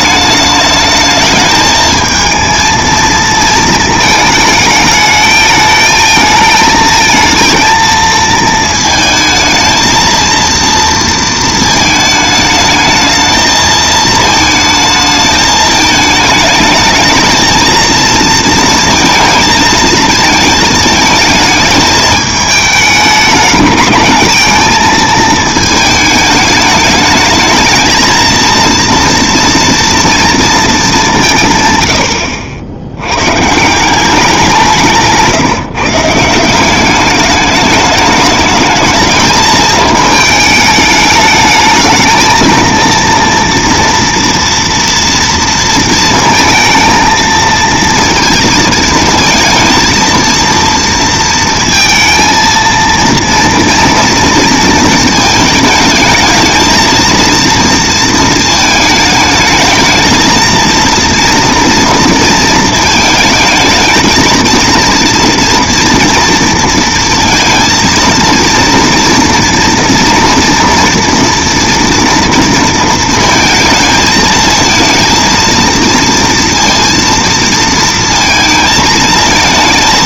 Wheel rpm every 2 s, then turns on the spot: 210, 220, 220, 220, 220, 230, 220, 220, 210, 230, 220, 210, 220, 210, 230, 220, 70, 180, 180, 220, 210, 230, 230, 230, 230, 230, 230, 230, 220, 220, 230, 220, 230, 230, 230, 230, 230, 220, 230, 220.
none